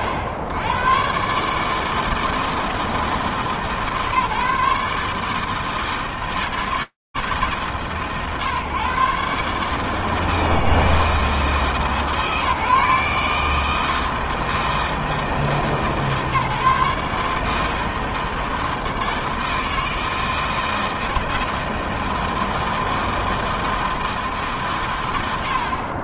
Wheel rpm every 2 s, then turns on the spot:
90, 160, 150, 160, 120, 160, 150, 160, 140, 160, 160, 160, 150.
none